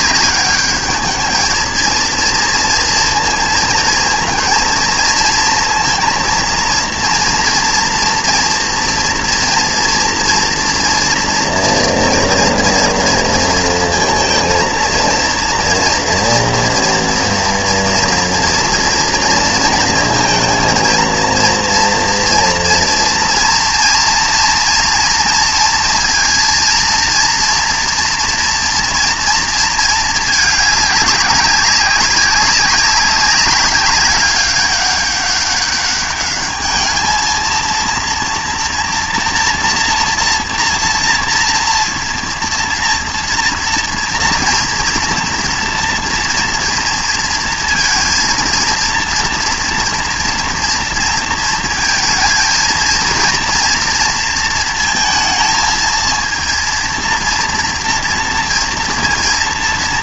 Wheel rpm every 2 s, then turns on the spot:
210, 240, 230, 230, 240, 230, 230, 230, 230, 230, 230, 230, 230, 230, 240, 210, 200, 200, 210, 230, 240, 230, 230, 230, 230, 230, 230, 230, 230, 230.
none